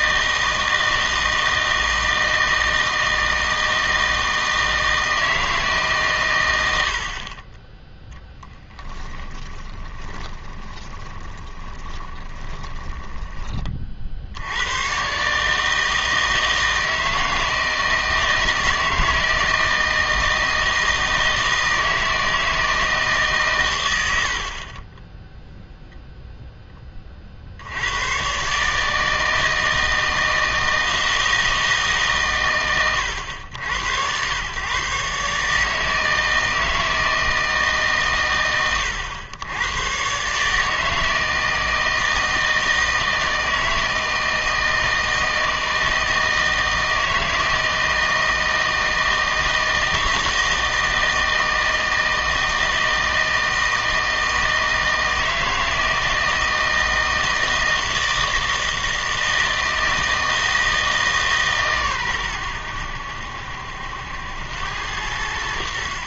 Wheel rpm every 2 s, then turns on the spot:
160, 160, 160, 100, 10, 20, 20, 90, 160, 160, 160, 160, 50, 10, 140, 160, 120, 120, 160, 100, 150, 160, 160, 160, 160, 160, 160, 160, 160, 160, 160, 100, 90.
8-14